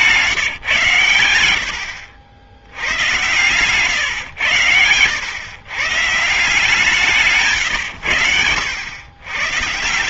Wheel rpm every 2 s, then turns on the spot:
130, 70, 100, 150, 100.
none